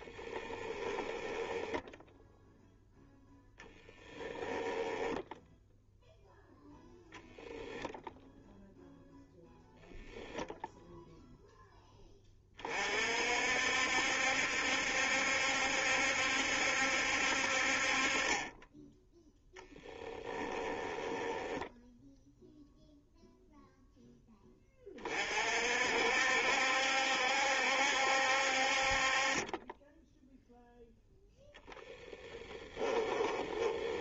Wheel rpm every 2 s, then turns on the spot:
10, 0, 10, 0, 0, 0, 40, 70, 70, 10, 10, 0, 30, 70, 50, 0, 10.
0-2 4-6 20-22 32-34